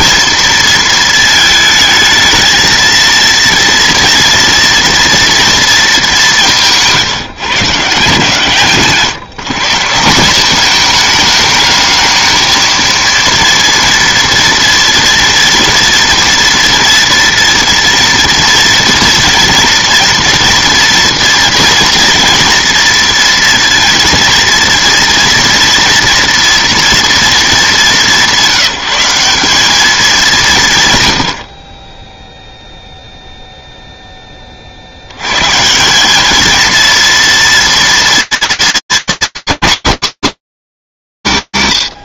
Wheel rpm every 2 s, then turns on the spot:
220, 230, 230, 160, 140, 210, 230, 230, 230, 230, 230, 230, 230, 240, 190, 130, 0, 80, 230, 230, 230.
8-10